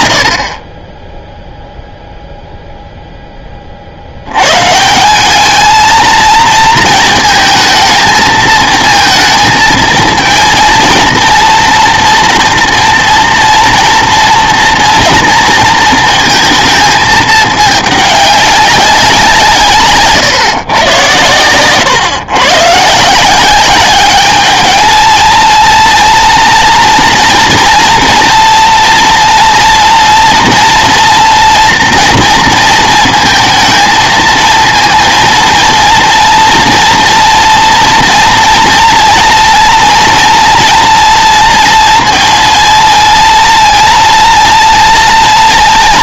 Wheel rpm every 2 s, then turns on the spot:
20, 0, 160, 230, 230, 230, 230, 230, 220, 190, 130, 140, 220, 240, 230, 230, 230, 230, 230, 240, 230, 230, 230.
none